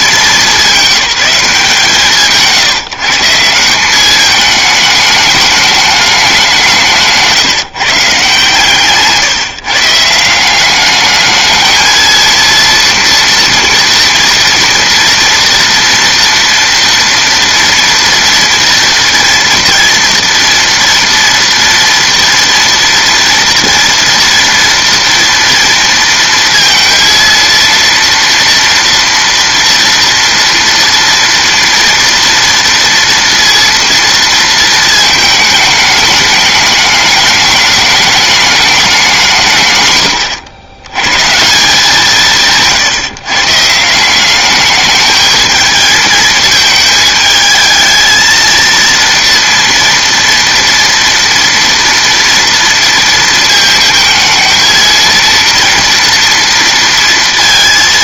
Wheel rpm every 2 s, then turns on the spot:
200, 120, 210, 160, 150, 190, 230, 230, 230, 230, 240, 230, 230, 230, 230, 230, 230, 230, 210, 210, 90, 150, 200, 220, 230, 230, 230, 230, 230.
8-10